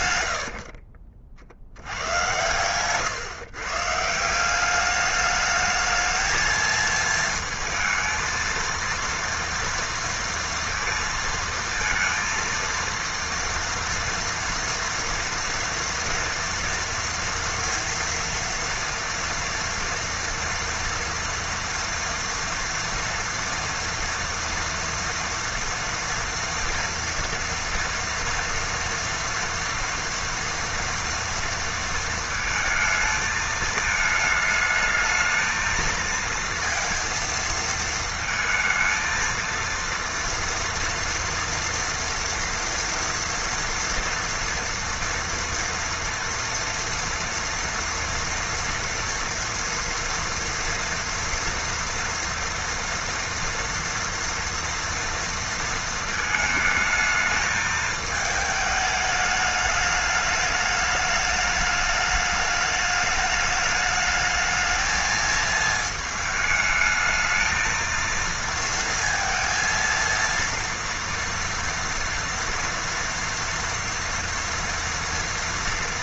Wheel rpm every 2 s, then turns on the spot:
50, 120, 200, 220, 230, 230, 230, 230, 230, 230, 230, 230, 230, 230, 240, 230, 220, 220, 230, 220, 230, 230, 230, 230, 230, 230, 230, 240, 220, 210, 210, 210, 220, 220, 230, 230, 230, 230.
0-2